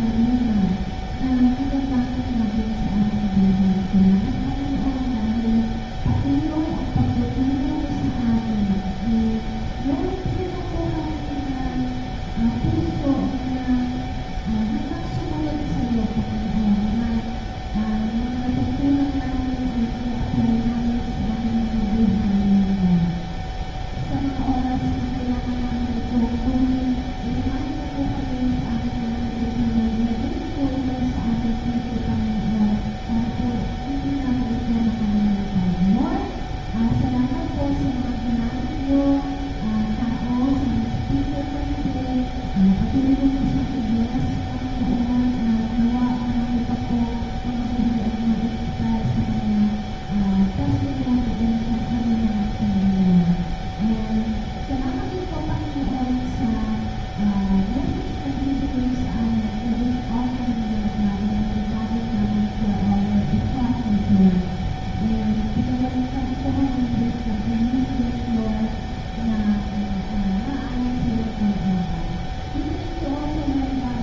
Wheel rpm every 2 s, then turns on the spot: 0, 0, 0, 0, 0, 0, 0, 0, 0, 0, 0, 0, 0, 0, 0, 0, 0, 0, 0, 0, 0, 0, 0, 0, 0, 0, 0, 0, 0, 0, 0, 0, 0, 0, 0, 0, 0.
none